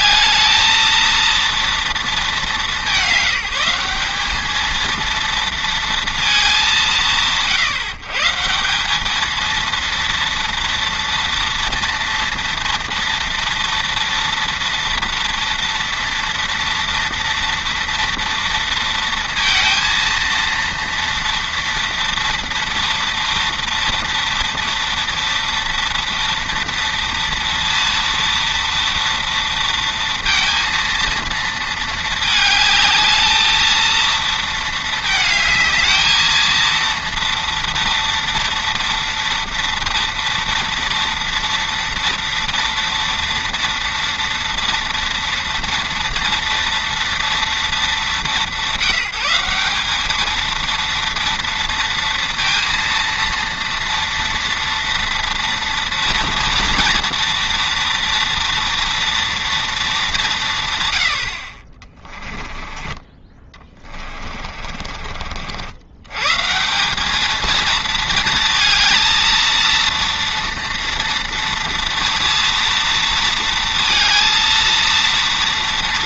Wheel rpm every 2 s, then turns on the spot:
220, 200, 220, 200, 180, 230, 230, 230, 230, 230, 230, 230, 230, 230, 230, 230, 210, 220, 230, 240, 230, 230, 230, 230, 170, 230, 230, 230, 230, 230, 130, 20, 40, 170, 230, 230, 230, 230.
62-66